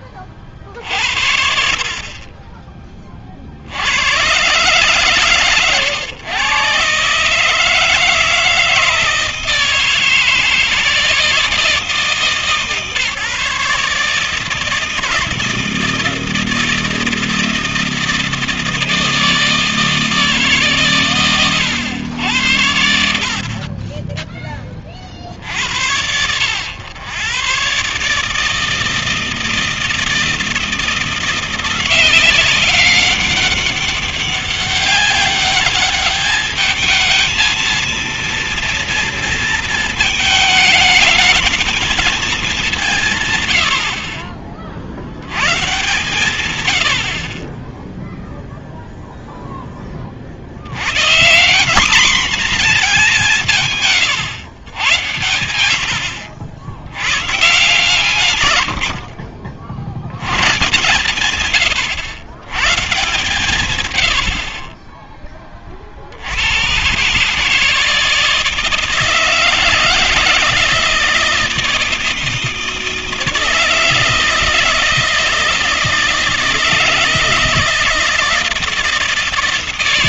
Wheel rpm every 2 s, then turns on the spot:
20, 20, 120, 120, 160, 160, 150, 160, 160, 160, 140, 90, 20, 90, 160, 170, 190, 190, 210, 230, 220, 200, 50, 110, 0, 90, 220, 120, 80, 110, 120, 120, 40, 120, 160, 160, 160, 160, 160, 160.
none